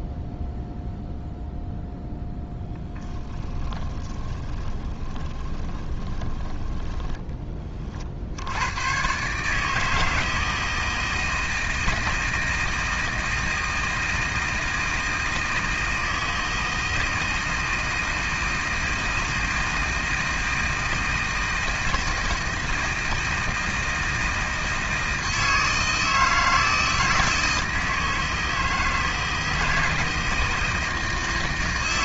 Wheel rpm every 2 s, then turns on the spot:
0, 10, 20, 20, 120, 160, 160, 160, 160, 160, 160, 160, 160, 160, 160, 160.
2-8